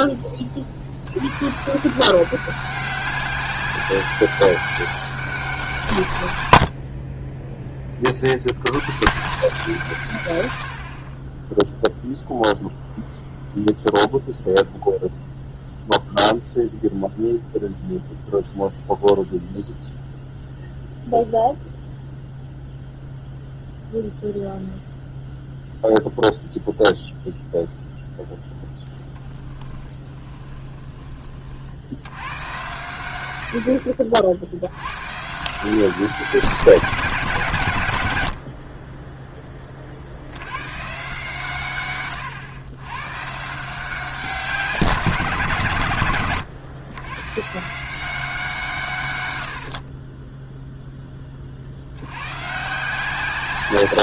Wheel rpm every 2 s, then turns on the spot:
40, 190, 200, 80, 110, 80, 0, 0, 0, 0, 0, 0, 0, 0, 0, 20, 110, 80, 170, 50, 110, 110, 170, 120, 160, 0, 140.
30-32